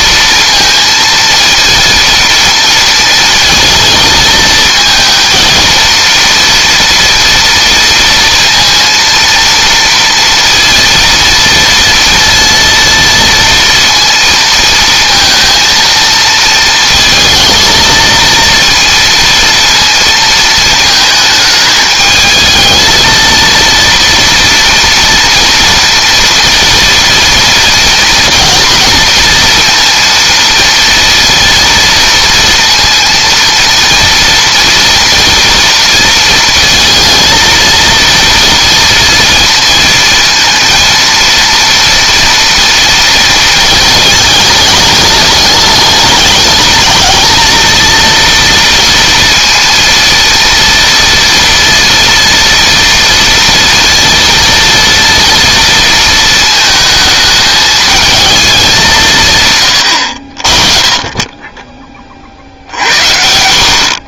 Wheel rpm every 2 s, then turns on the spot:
230, 230, 230, 230, 230, 230, 230, 230, 230, 230, 220, 220, 230, 230, 230, 230, 230, 230, 230, 230, 230, 230, 210, 220, 230, 230, 230, 230, 220, 170, 30, 70.
none